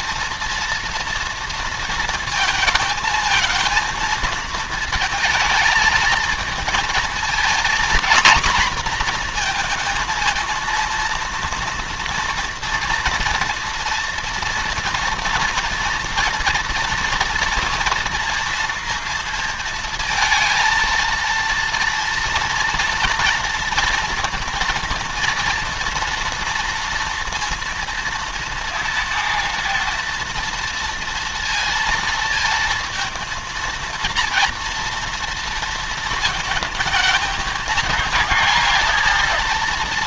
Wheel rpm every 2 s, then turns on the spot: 240, 220, 220, 230, 230, 230, 240, 230, 240, 230, 230, 230, 230, 230, 230, 230, 230, 230, 220, 230.
none